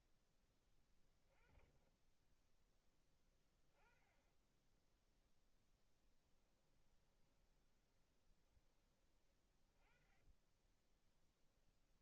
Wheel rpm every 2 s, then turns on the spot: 20, 10, 0, 20, 20, 10.
6-8 10-12